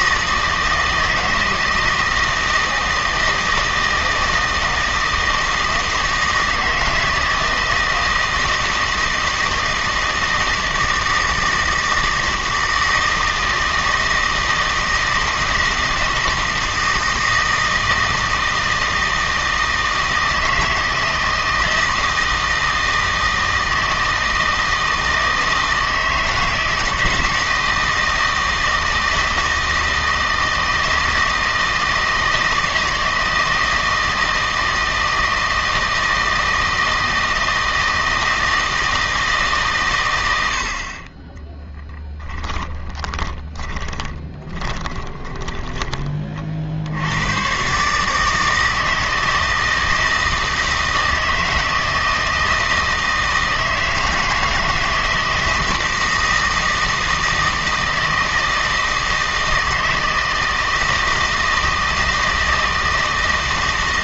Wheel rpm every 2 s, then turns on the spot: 160, 160, 160, 160, 160, 160, 160, 160, 160, 160, 160, 160, 160, 160, 160, 160, 160, 160, 160, 160, 30, 10, 20, 70, 160, 160, 160, 160, 160, 160, 160, 160.
42-46